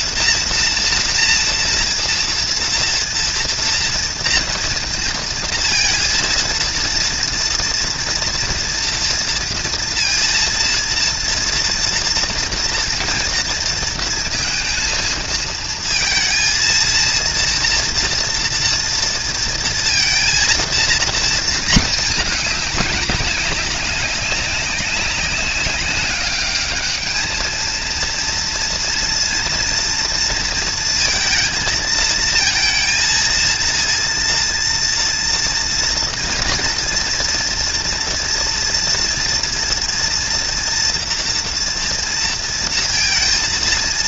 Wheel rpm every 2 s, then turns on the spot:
230, 230, 230, 230, 230, 230, 230, 230, 230, 230, 230, 210, 190, 210, 230, 230, 230, 230, 230, 230, 230, 230.
none